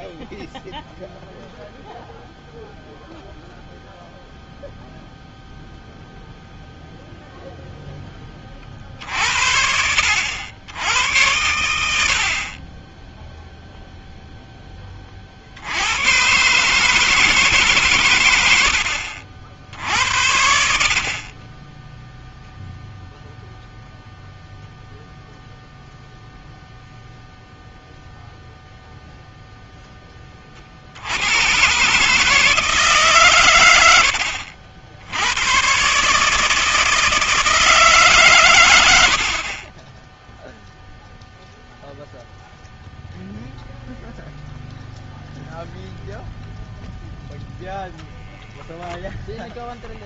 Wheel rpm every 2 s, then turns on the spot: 0, 0, 0, 0, 30, 80, 50, 0, 130, 100, 80, 0, 0, 0, 0, 30, 150, 80, 150, 130, 10, 0, 0, 0, 0.
none